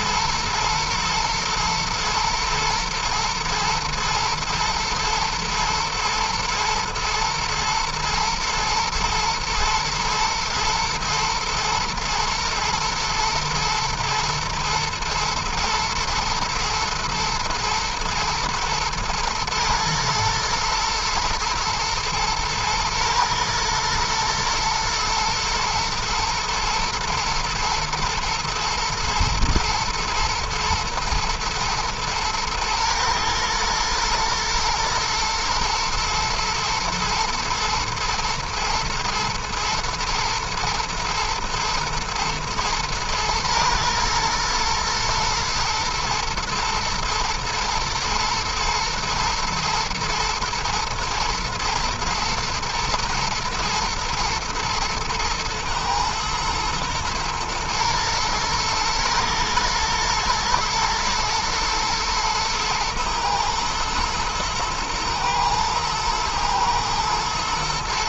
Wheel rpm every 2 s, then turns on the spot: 120, 110, 110, 110, 120, 110, 120, 110, 110, 120, 110, 110, 110, 120, 120, 110, 110, 110, 120, 110, 120, 110, 110, 110, 110, 120, 110, 120, 120, 120, 110, 110, 120, 120.
none